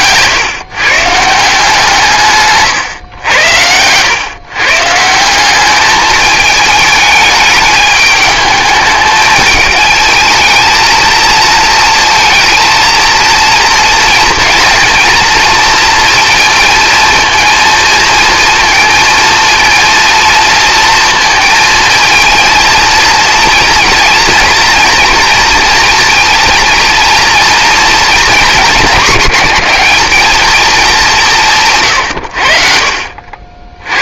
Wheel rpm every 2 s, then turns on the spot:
130, 140, 140, 220, 210, 220, 230, 230, 230, 230, 230, 230, 230, 230, 220, 220, 70.
none